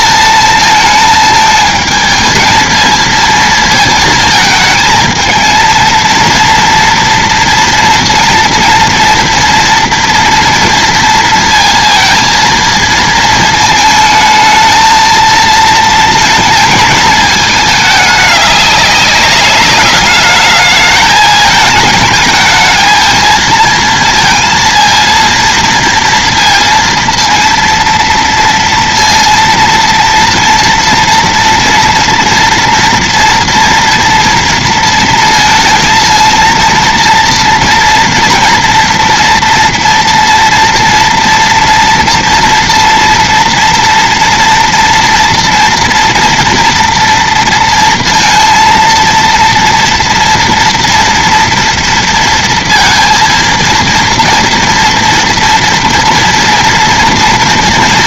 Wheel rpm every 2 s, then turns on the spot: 220, 220, 220, 230, 230, 230, 230, 220, 220, 200, 210, 220, 230, 230, 230, 230, 230, 230, 230, 230, 230, 230, 230, 230, 230, 230, 230, 230, 230.
none